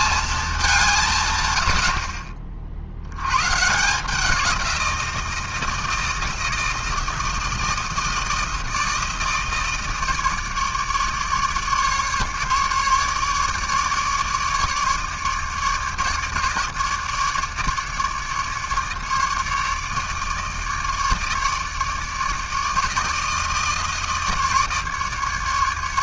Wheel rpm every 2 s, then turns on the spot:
200, 50, 180, 160, 160, 150, 150, 150, 150, 150, 150, 150, 150.
none